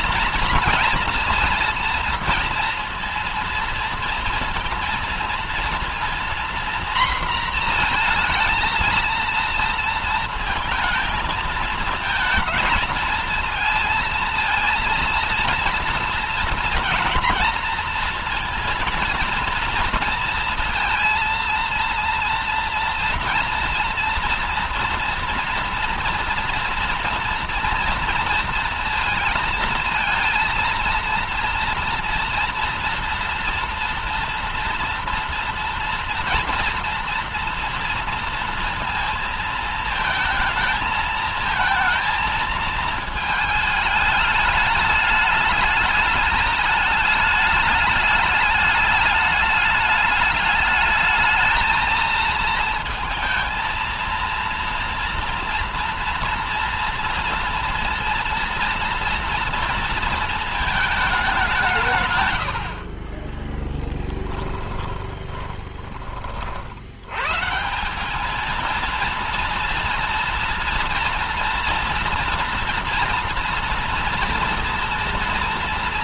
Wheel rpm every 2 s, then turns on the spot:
230, 230, 230, 240, 230, 230, 220, 230, 230, 230, 230, 230, 230, 230, 230, 230, 230, 230, 230, 230, 220, 220, 210, 210, 210, 210, 230, 230, 230, 230, 220, 90, 10, 60, 220, 230, 230, 240.
64-66